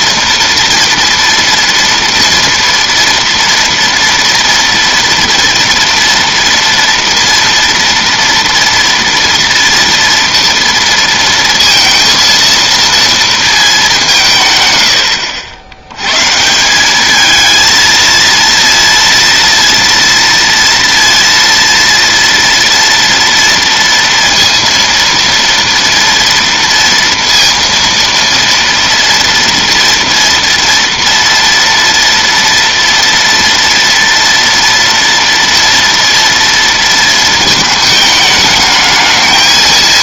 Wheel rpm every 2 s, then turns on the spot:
230, 230, 230, 230, 230, 230, 230, 120, 170, 230, 230, 240, 230, 230, 240, 230, 230, 230, 230, 210.
none